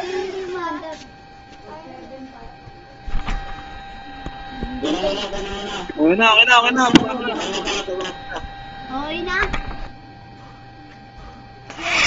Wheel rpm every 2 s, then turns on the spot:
0, 0, 0, 0, 0, 0.
none